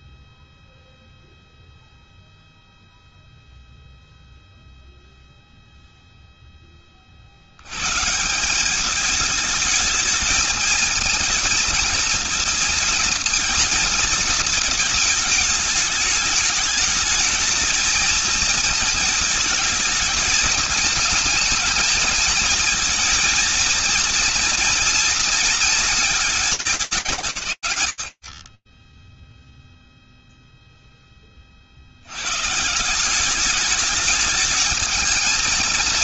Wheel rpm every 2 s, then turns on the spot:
0, 0, 0, 20, 190, 230, 230, 220, 210, 220, 220, 230, 230, 200, 30, 0, 150, 220.
none